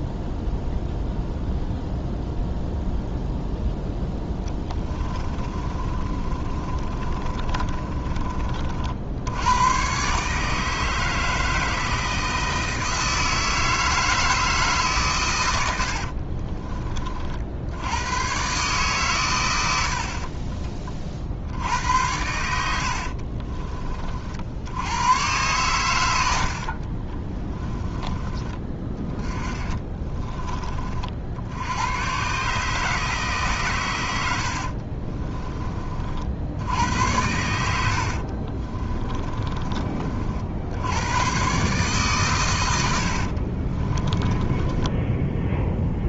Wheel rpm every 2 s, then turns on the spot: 0, 0, 20, 30, 50, 160, 160, 140, 30, 120, 30, 70, 100, 40, 20, 40, 150, 50, 80, 30, 90, 90, 10.
4-8 22-24 34-36 38-40 42-46